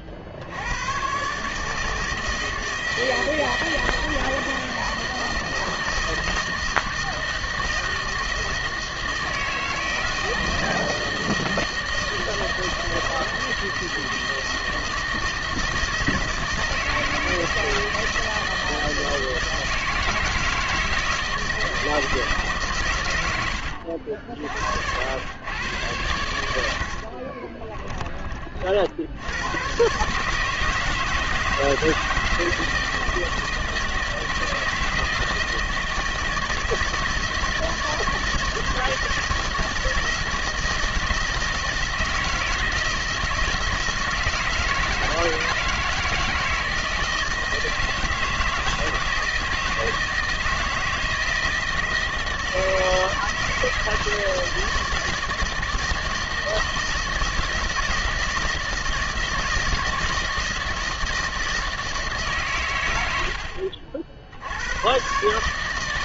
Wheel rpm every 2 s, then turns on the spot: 80, 160, 160, 160, 160, 160, 160, 160, 160, 160, 160, 150, 60, 80, 50, 160, 160, 160, 160, 160, 160, 160, 160, 160, 160, 160, 160, 160, 160, 160, 160, 120, 90.
none